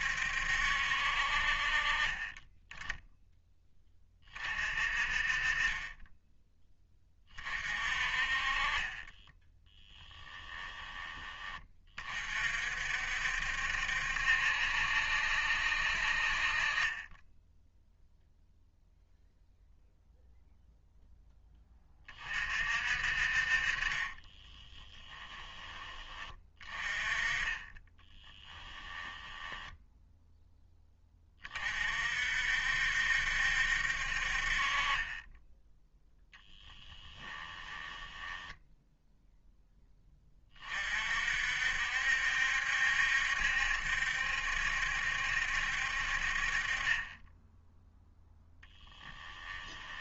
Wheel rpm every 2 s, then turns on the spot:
70, 10, 40, 10, 30, 20, 50, 70, 40, 0, 0, 50, 20, 20, 10, 10, 60, 40, 10, 10, 30, 70, 70, 40, 0.
10-12 24-26 28-30 34-40